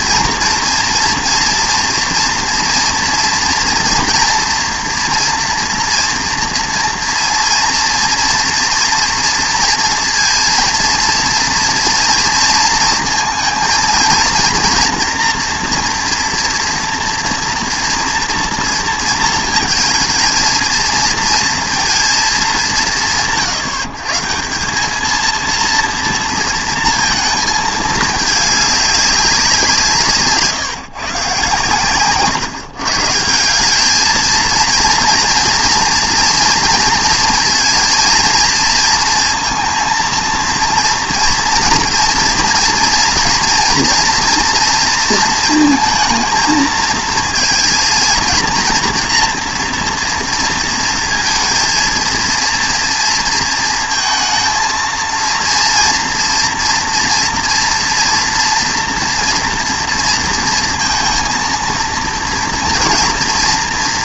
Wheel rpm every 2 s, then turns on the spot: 230, 230, 240, 230, 230, 230, 230, 230, 230, 230, 220, 160, 190, 230, 200, 140, 140, 230, 230, 230, 230, 230, 230, 220, 230, 230, 230, 220, 230, 230, 230, 230.
none